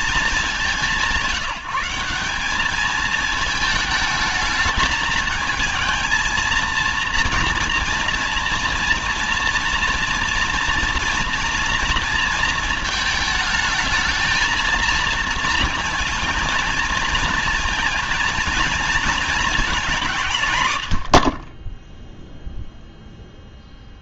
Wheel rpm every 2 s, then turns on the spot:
170, 210, 220, 230, 230, 230, 220, 220, 230, 230, 120, 0.
none